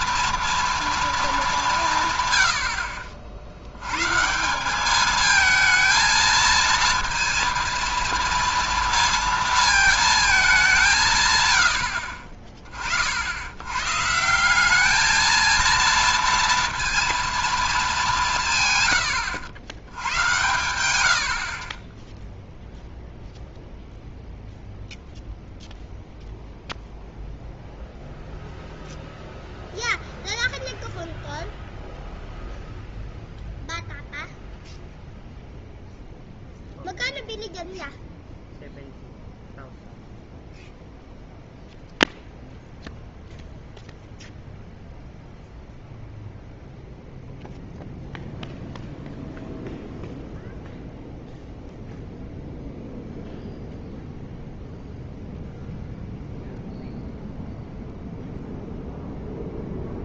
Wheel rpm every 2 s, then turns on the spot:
230, 90, 170, 230, 230, 200, 30, 190, 230, 140, 100, 0, 0, 0, 0, 0, 0, 0, 0, 0, 0, 0, 0, 0, 0, 0, 0, 0, 0, 0.
none